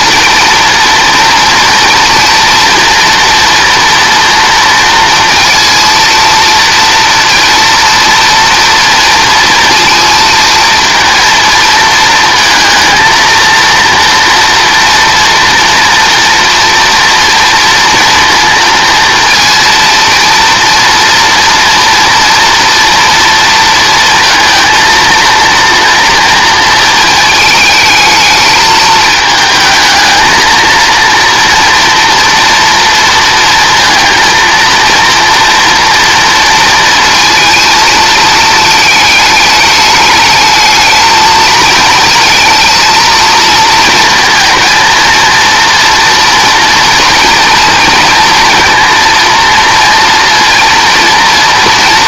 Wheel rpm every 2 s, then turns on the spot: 230, 230, 230, 230, 240, 230, 230, 240, 230, 230, 230, 240, 230, 230, 210, 230, 230, 230, 220, 220, 220, 230, 230, 230, 230, 240.
none